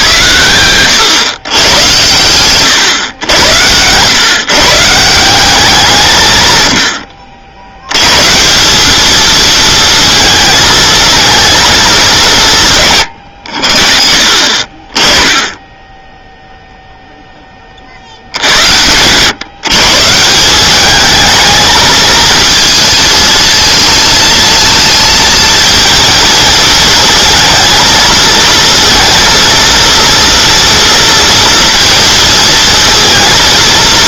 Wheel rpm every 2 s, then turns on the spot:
100, 120, 150, 110, 180, 220, 150, 40, 0, 80, 190, 220, 220, 220, 220, 230, 230.
none